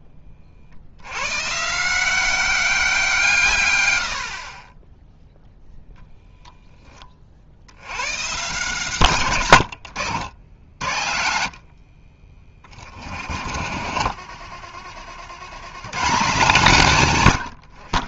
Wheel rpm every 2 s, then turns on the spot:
60, 180, 20, 10, 140, 70, 30, 60, 150.
10-14